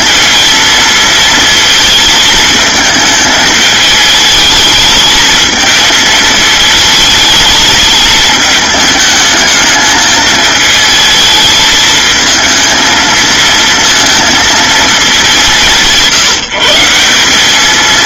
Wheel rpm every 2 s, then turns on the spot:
230, 220, 220, 220, 210, 220, 220, 220, 170.
none